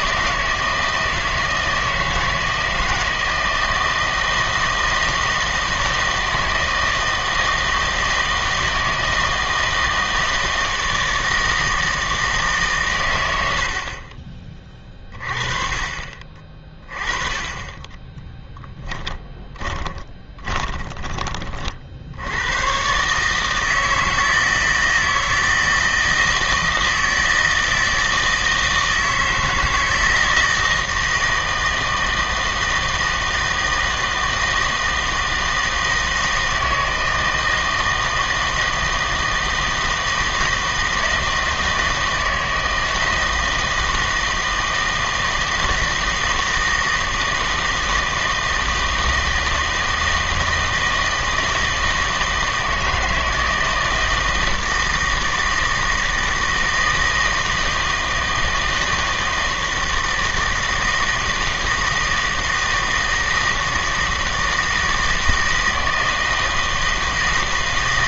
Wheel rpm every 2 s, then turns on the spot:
160, 160, 160, 160, 160, 160, 140, 20, 30, 10, 20, 120, 160, 160, 160, 160, 160, 160, 160, 160, 160, 160, 160, 160, 160, 160, 160, 160, 160, 160, 160, 160, 160, 160.
18-22